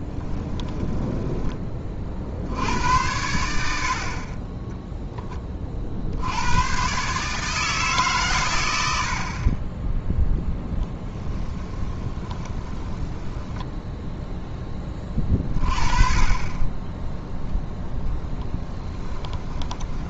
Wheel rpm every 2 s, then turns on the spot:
10, 70, 20, 130, 90, 10, 20, 10, 20, 10.
0-2 10-14 18-20